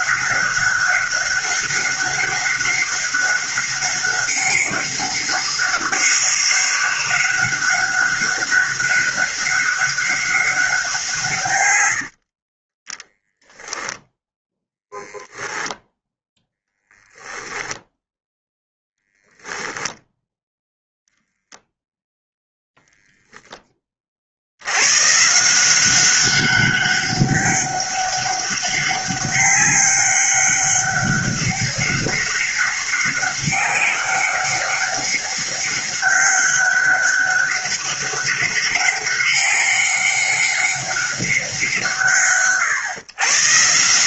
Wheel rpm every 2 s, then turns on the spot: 200, 200, 200, 200, 200, 170, 10, 0, 10, 0, 0, 0, 120, 200, 200, 200, 200, 200, 200, 200, 200, 130.
none